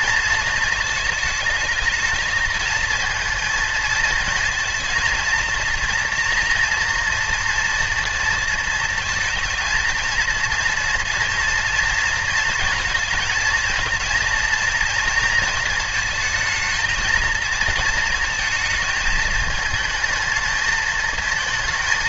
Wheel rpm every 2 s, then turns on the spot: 220, 230, 230, 230, 230, 230, 230, 230, 220, 220, 220.
none